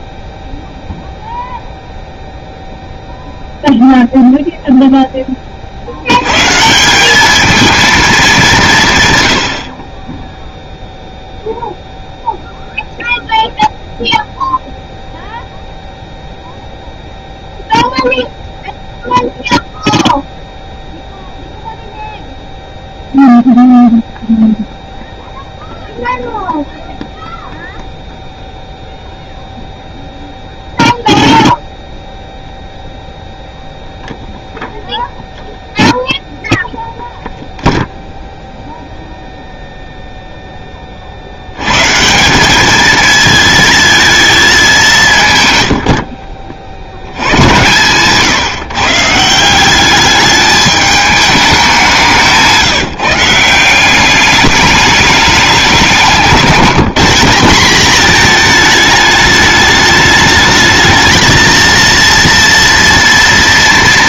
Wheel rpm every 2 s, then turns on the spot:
0, 0, 0, 180, 140, 0, 0, 0, 0, 0, 0, 0, 0, 0, 0, 0, 0, 0, 0, 0, 40, 220, 170, 70, 150, 210, 160, 210, 200, 210, 220, 230.
none